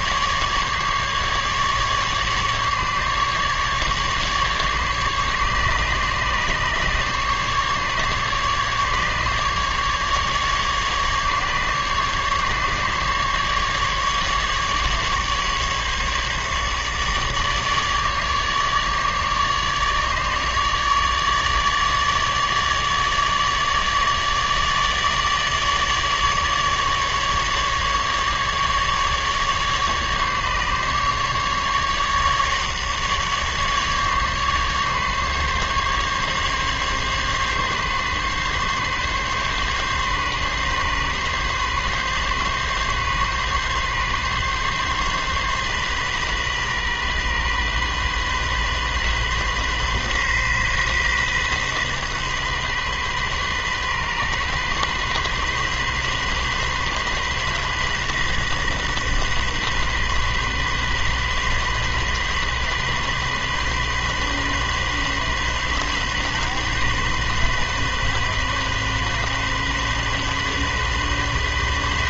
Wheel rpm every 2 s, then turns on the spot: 150, 150, 150, 150, 150, 150, 150, 140, 150, 150, 150, 150, 150, 150, 150, 140, 150, 140, 140, 140, 140, 140, 140, 130, 130, 130, 130, 130, 130, 130, 130, 130, 130, 130, 130, 130.
none